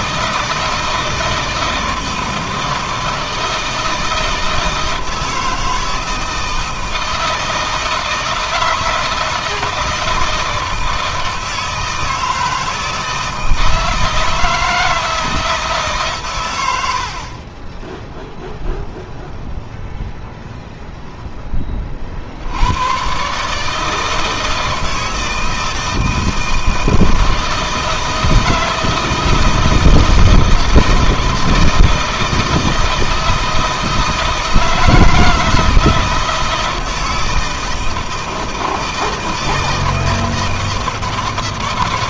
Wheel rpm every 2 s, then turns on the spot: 160, 160, 160, 160, 160, 160, 160, 160, 80, 0, 0, 110, 160, 160, 160, 160, 160, 160, 160, 160, 160.
none